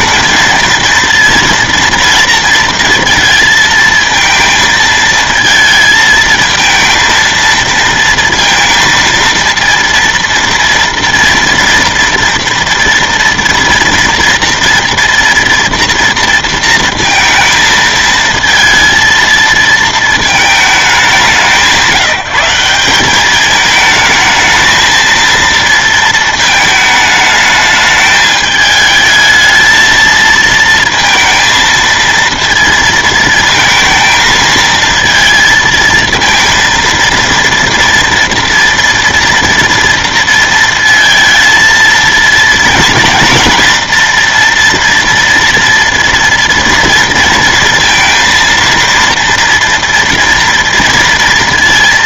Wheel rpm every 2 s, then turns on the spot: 230, 230, 220, 230, 230, 240, 230, 230, 230, 230, 190, 180, 220, 220, 220, 230, 230, 220, 230, 230, 230, 230, 230, 230, 230, 230.
none